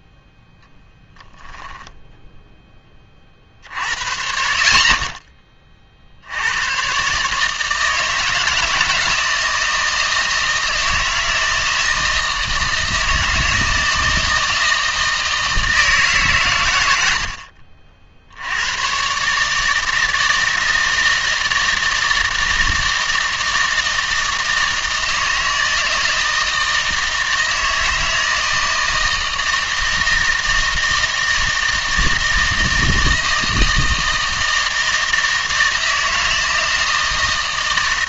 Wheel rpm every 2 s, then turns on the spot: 0, 10, 50, 90, 160, 160, 160, 160, 110, 90, 160, 160, 160, 160, 160, 160, 160, 160, 160.
none